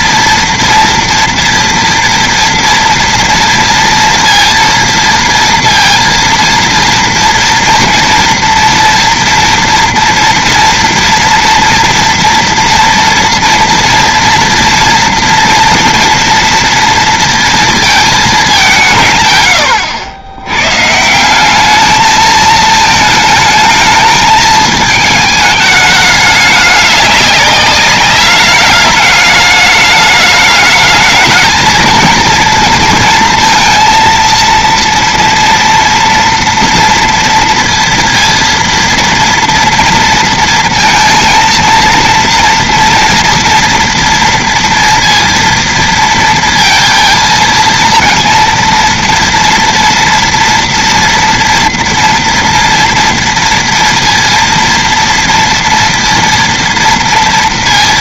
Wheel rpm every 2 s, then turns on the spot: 230, 230, 230, 230, 230, 230, 230, 230, 230, 150, 160, 220, 220, 200, 210, 220, 230, 230, 230, 230, 220, 230, 230, 230, 230, 230, 230, 230, 230.
none